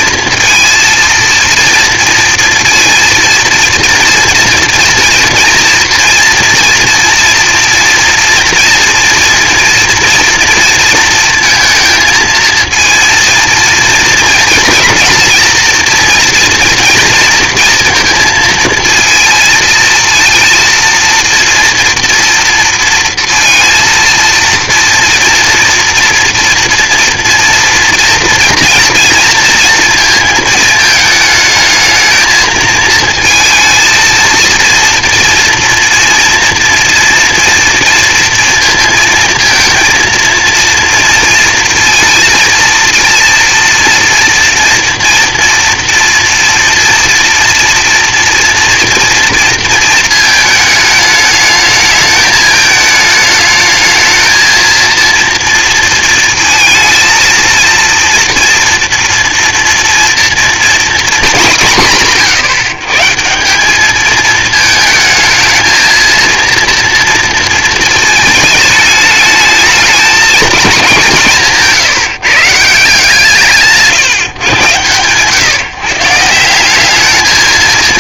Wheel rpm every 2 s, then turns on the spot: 230, 230, 240, 230, 230, 230, 220, 220, 230, 230, 230, 230, 230, 230, 230, 220, 230, 230, 230, 230, 230, 230, 240, 240, 230, 220, 220, 220, 230, 230, 240, 150, 220, 230, 220, 220, 170, 130, 190.
none